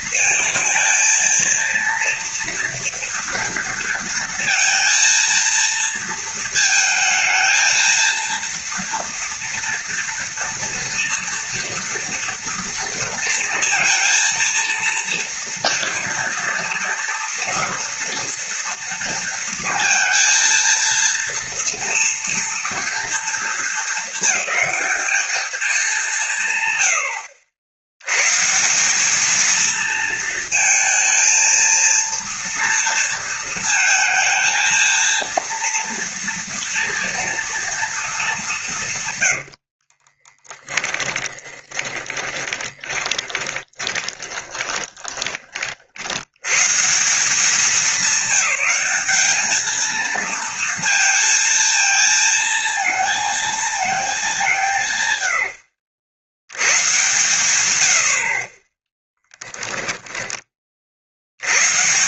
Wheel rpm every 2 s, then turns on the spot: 220, 240, 230, 230, 240, 230, 230, 230, 230, 230, 230, 230, 220, 110, 190, 220, 230, 230, 240, 160, 20, 20, 30, 140, 210, 230, 230, 150, 110, 20, 50.
40-46